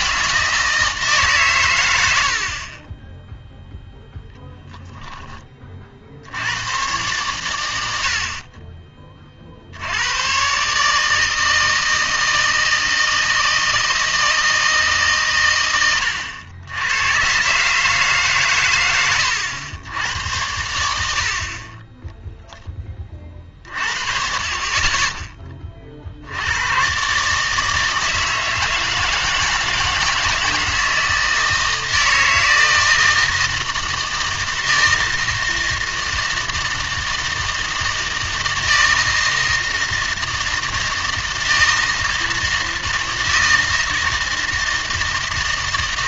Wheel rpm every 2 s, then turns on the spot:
160, 30, 0, 110, 30, 140, 160, 160, 90, 120, 90, 10, 30, 110, 160, 160, 160, 160, 160, 160, 160, 160, 160.
none